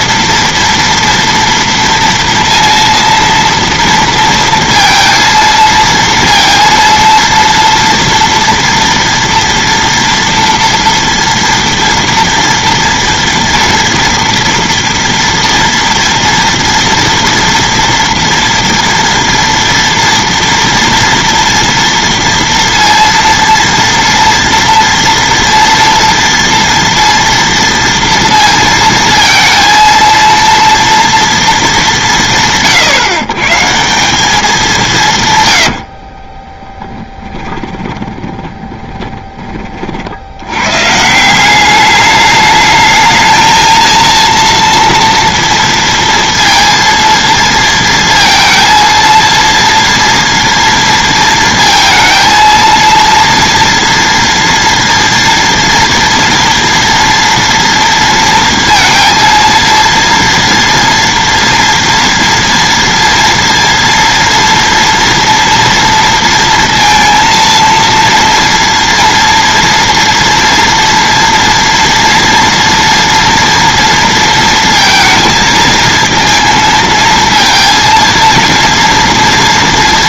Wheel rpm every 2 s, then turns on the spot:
230, 230, 230, 230, 240, 230, 230, 230, 230, 230, 230, 230, 230, 230, 230, 230, 150, 200, 30, 20, 90, 210, 230, 230, 230, 230, 230, 230, 230, 230, 230, 230, 230, 230, 240, 230, 230, 230, 230, 230.
36-40